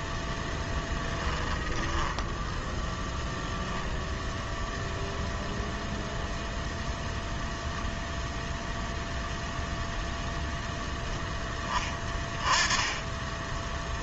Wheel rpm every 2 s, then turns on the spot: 10, 0, 0, 0, 0, 0, 10.
none